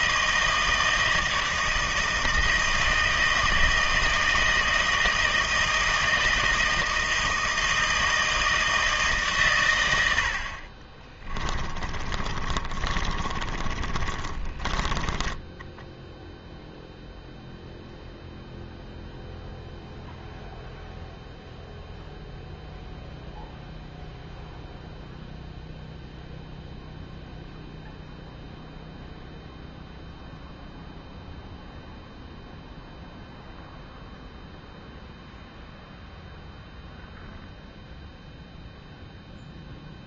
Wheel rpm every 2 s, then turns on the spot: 160, 160, 160, 160, 160, 50, 30, 40, 0, 0, 0, 0, 0, 0, 0, 0, 0, 0, 0, 0.
12-16